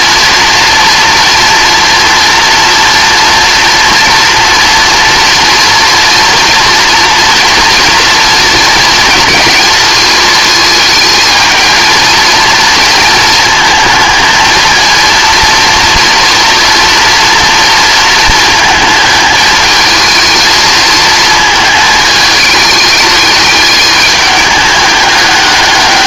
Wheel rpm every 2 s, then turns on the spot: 230, 240, 240, 230, 230, 220, 230, 230, 230, 220, 220, 210, 200.
none